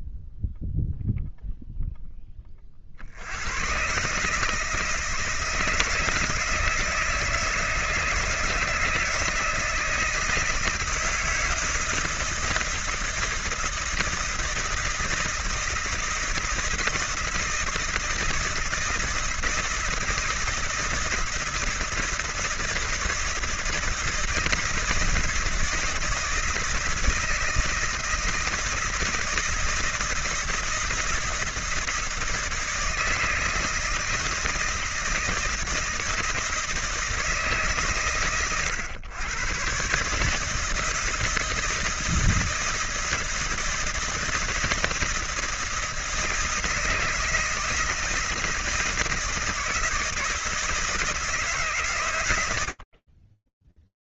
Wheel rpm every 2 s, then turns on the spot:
0, 70, 160, 160, 160, 160, 160, 160, 160, 160, 160, 160, 160, 160, 160, 160, 160, 160, 160, 110, 150, 160, 160, 160, 170, 160, 90.
none